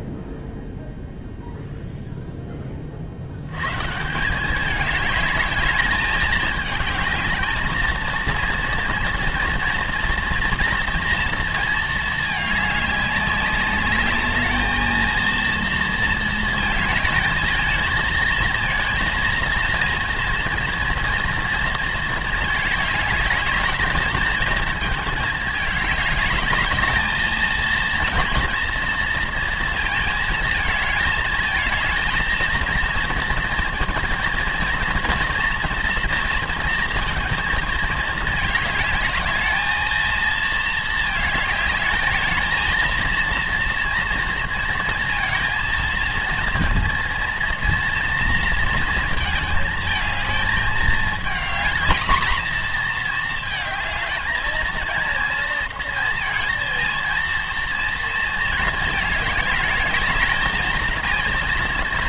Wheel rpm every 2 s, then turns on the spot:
0, 60, 210, 220, 230, 230, 200, 230, 220, 230, 230, 210, 220, 220, 230, 220, 230, 230, 230, 220, 220, 230, 230, 230, 230, 220, 220, 230, 230, 220, 230.
none